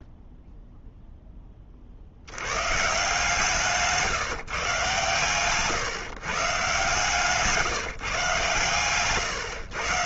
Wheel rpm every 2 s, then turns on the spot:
0, 130, 130, 140, 120.
none